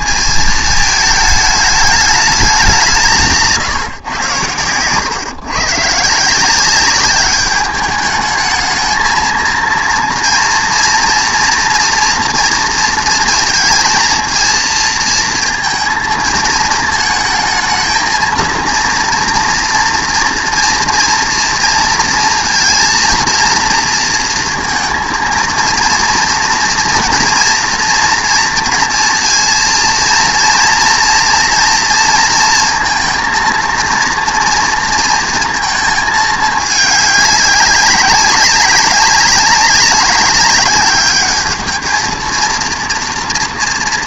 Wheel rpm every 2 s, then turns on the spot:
220, 190, 120, 190, 220, 240, 230, 230, 220, 230, 230, 230, 230, 230, 230, 230, 230, 230, 210, 190, 200, 230.
none